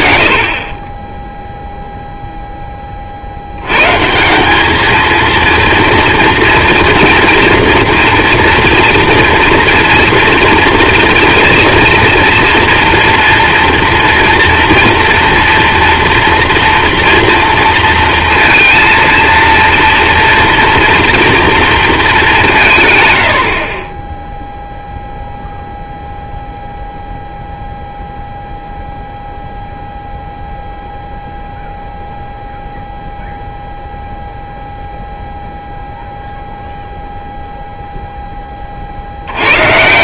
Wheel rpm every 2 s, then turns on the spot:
30, 10, 180, 230, 240, 230, 230, 230, 240, 230, 230, 180, 0, 0, 0, 0, 0, 0, 0, 20.
none